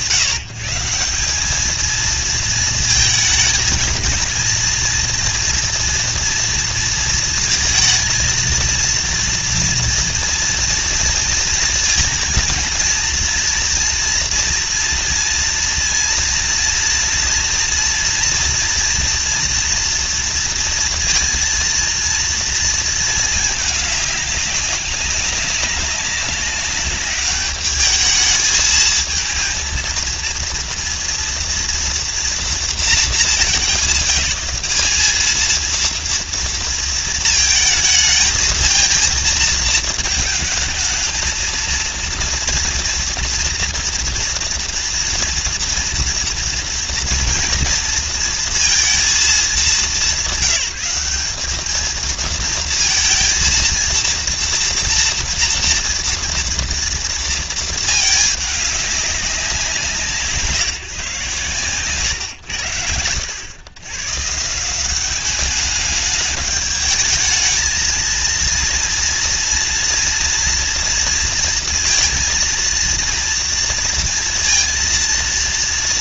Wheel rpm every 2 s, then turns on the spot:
160, 220, 230, 230, 230, 230, 230, 230, 230, 230, 230, 230, 190, 200, 220, 230, 210, 210, 230, 220, 220, 230, 230, 230, 230, 200, 230, 230, 230, 210, 140, 100, 190, 210, 230, 240, 230, 230.
none